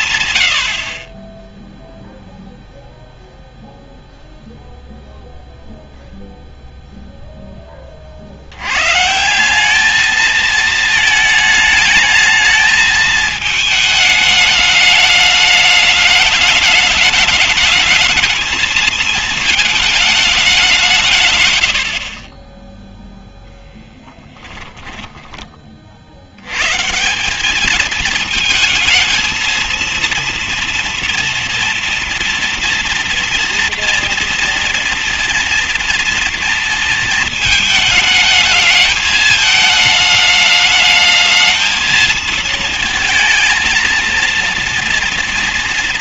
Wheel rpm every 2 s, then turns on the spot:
90, 0, 0, 0, 100, 220, 220, 210, 210, 220, 170, 20, 10, 130, 230, 240, 230, 230, 230, 220, 210, 230, 230.
24-26